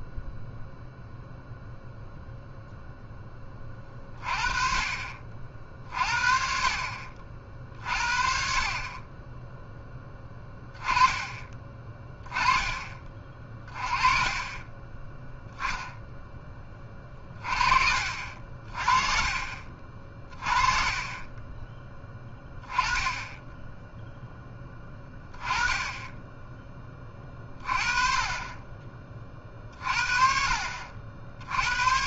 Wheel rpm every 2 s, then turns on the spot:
0, 0, 30, 50, 30, 10, 20, 20, 20, 40, 30, 10, 10, 20, 30, 60.
14-16